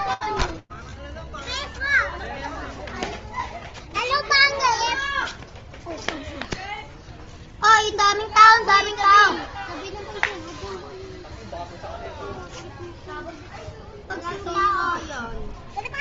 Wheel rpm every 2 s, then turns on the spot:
0, 0, 0, 0, 0, 0, 0, 0.
none